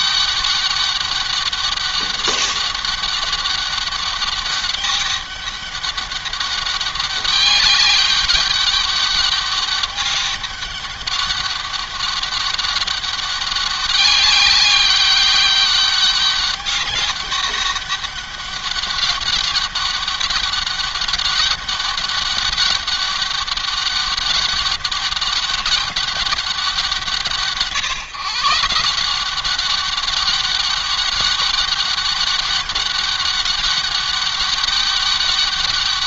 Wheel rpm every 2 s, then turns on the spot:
200, 200, 200, 200, 200, 200, 200, 200, 200, 200, 200, 200, 200, 170, 180, 200, 200, 200.
none